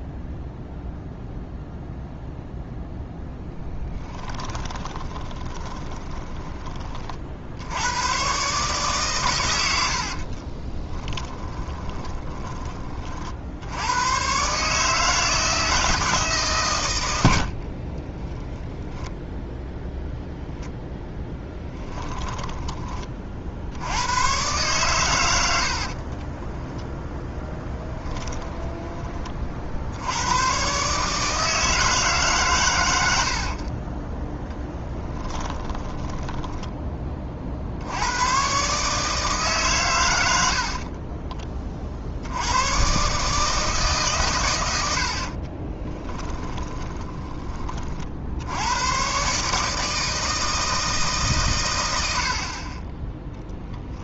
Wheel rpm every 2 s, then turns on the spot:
0, 0, 20, 20, 130, 20, 30, 150, 130, 0, 0, 20, 120, 10, 10, 120, 100, 10, 10, 130, 60, 110, 100, 20, 100, 160, 30.
4-8 10-12 26-30 34-36 40-42 46-48